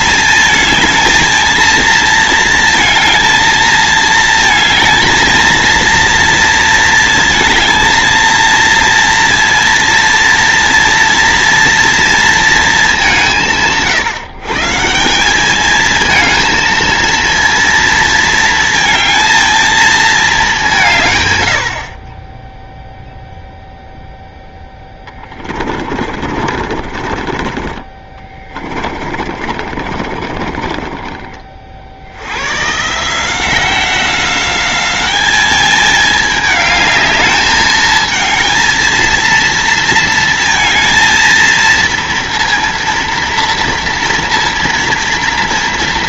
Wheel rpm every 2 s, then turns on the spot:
220, 230, 220, 230, 230, 230, 220, 160, 230, 230, 190, 10, 10, 50, 30, 30, 120, 200, 210, 230, 230, 230, 230.
24-32